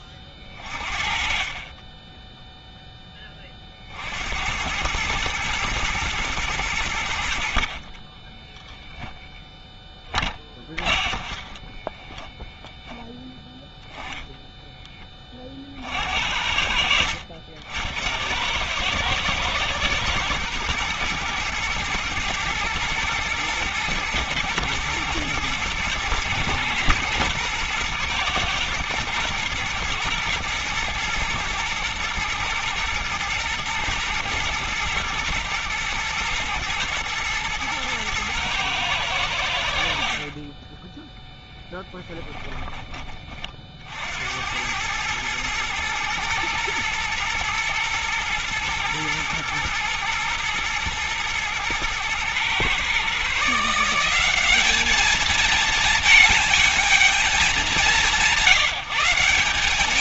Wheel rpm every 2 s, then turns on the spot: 30, 10, 70, 110, 10, 20, 10, 10, 60, 90, 110, 110, 110, 110, 120, 120, 120, 120, 120, 110, 40, 20, 80, 110, 120, 120, 120, 190, 220, 170.
8-14